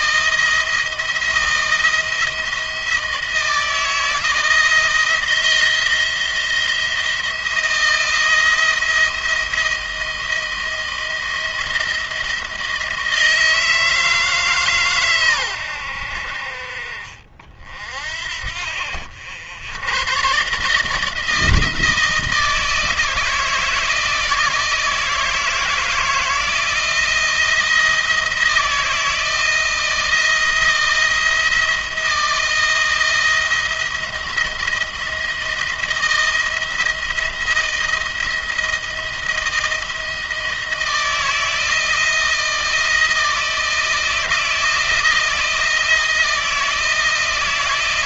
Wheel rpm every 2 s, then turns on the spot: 170, 170, 170, 170, 170, 170, 160, 140, 50, 60, 140, 160, 160, 170, 160, 170, 170, 160, 160, 160, 160, 170, 170, 160.
none